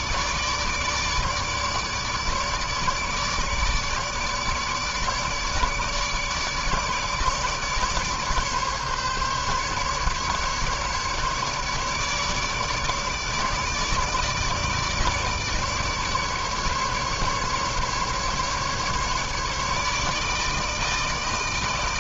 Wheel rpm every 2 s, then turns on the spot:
150, 150, 150, 150, 140, 150, 150, 150, 150, 140, 150.
none